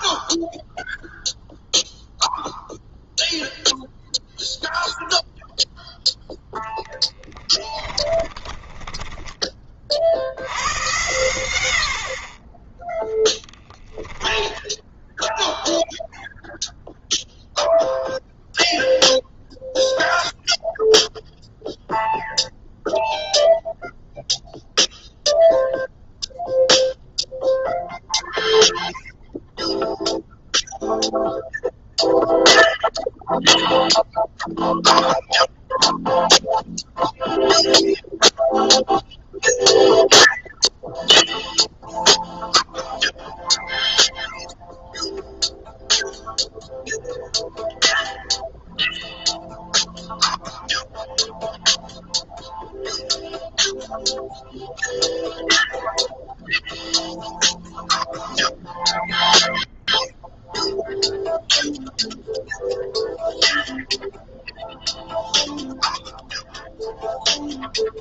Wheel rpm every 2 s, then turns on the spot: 0, 0, 0, 10, 20, 120, 20, 0, 0, 0, 0, 0, 0, 0, 0, 0, 0, 0, 0, 0, 0, 0, 0, 0, 0, 0, 0, 0, 0, 0, 0, 0, 0, 0.
6-10